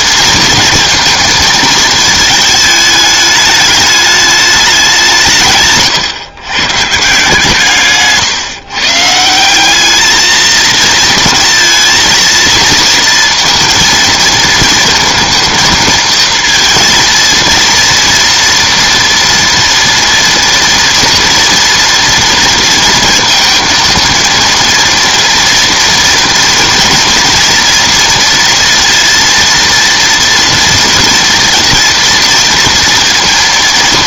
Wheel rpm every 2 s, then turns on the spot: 230, 220, 200, 130, 140, 230, 230, 230, 230, 230, 230, 230, 230, 230, 230, 230, 230.
none